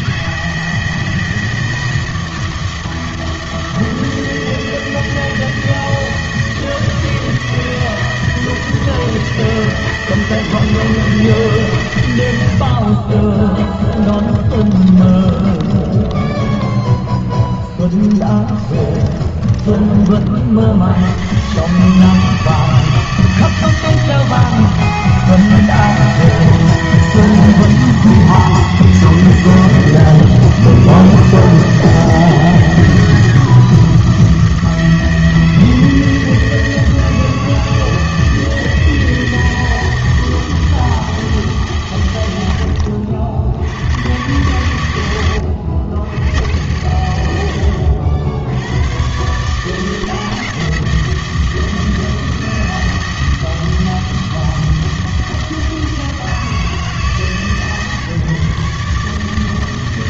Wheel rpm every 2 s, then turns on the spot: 160, 160, 160, 160, 160, 160, 80, 20, 10, 20, 70, 160, 160, 160, 160, 160, 160, 160, 160, 160, 160, 90, 110, 100, 100, 160, 160, 160, 160, 140.
14-16 18-20